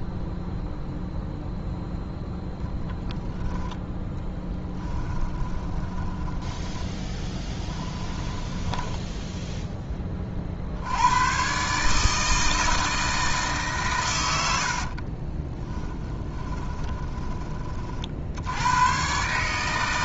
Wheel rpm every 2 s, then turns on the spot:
0, 10, 10, 10, 10, 80, 160, 60, 20, 100.
2-10 14-18